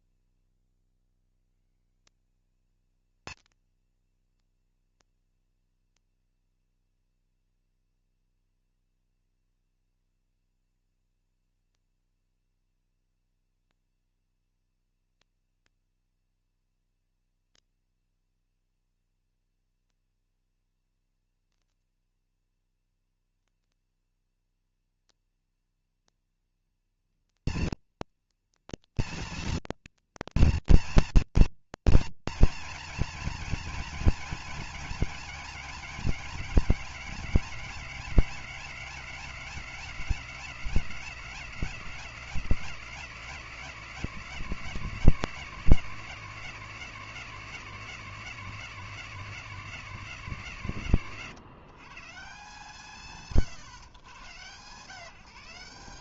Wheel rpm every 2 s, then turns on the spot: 130, 230, 230, 230, 230, 240, 230, 240, 230, 230, 230, 240, 230, 230, 230, 230, 230, 220, 220, 210, 210, 210, 200, 200, 200, 150, 130, 170.
none